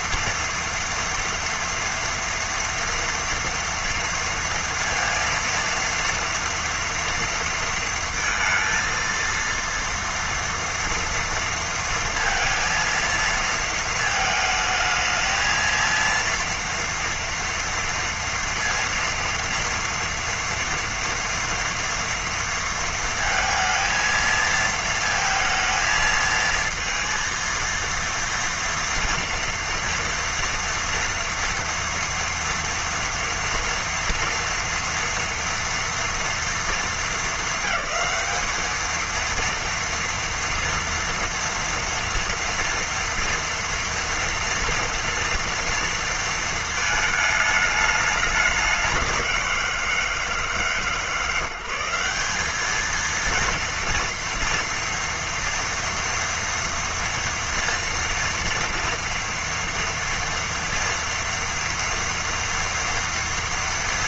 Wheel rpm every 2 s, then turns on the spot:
230, 230, 230, 230, 230, 230, 230, 220, 230, 230, 230, 230, 220, 230, 230, 230, 230, 230, 220, 220, 230, 230, 230, 220, 190, 160, 220, 230, 240, 230, 230, 230.
none